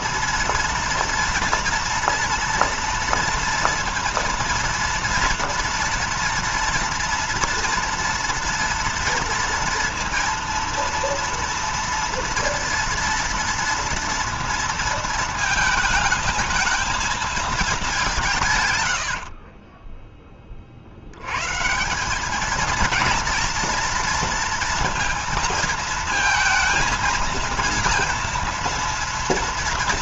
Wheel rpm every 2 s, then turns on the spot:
230, 230, 230, 230, 230, 230, 230, 230, 220, 140, 30, 200, 230, 230, 230.
none